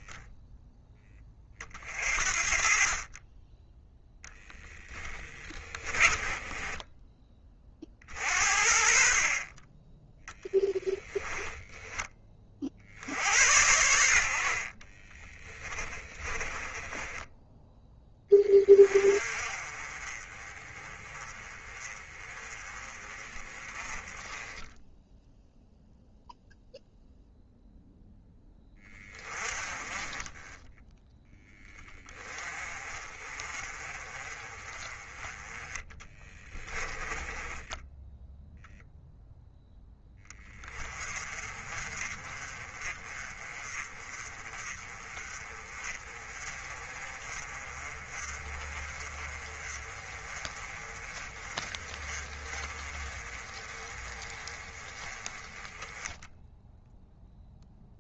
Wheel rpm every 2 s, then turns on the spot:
10, 40, 10, 20, 50, 20, 60, 40, 20, 30, 20, 30, 10, 0, 20, 10, 30, 20, 10, 0, 20, 30, 30, 30, 30, 30, 30, 20, 0.
4-8 10-12 14-18 36-38